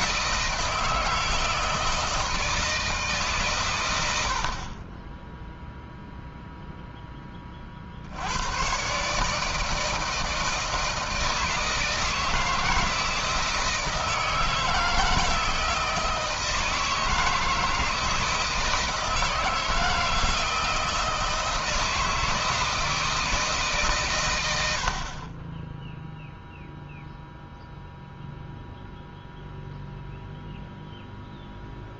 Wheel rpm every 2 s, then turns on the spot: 160, 160, 50, 0, 110, 160, 160, 160, 160, 160, 160, 160, 100, 0, 0, 0.
none